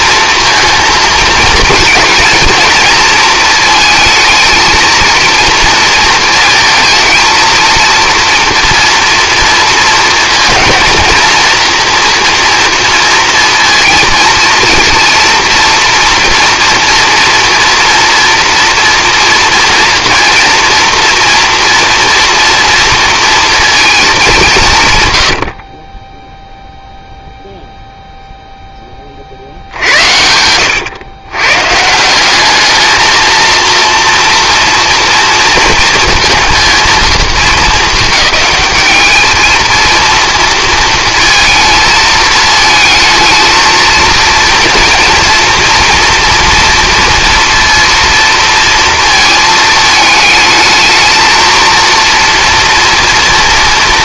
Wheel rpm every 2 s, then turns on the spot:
230, 230, 230, 220, 230, 230, 230, 230, 230, 240, 240, 230, 150, 0, 10, 100, 210, 230, 220, 200, 230, 220, 230, 230, 230, 220, 230.
none